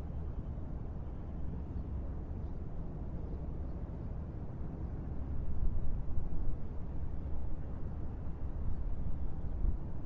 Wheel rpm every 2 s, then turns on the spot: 0, 0, 0, 0, 0.
none